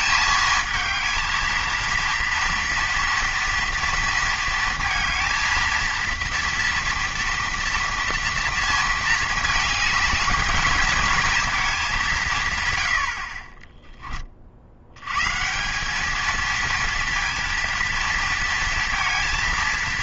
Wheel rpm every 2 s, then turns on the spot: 220, 230, 230, 230, 230, 230, 110, 70, 230, 230.
none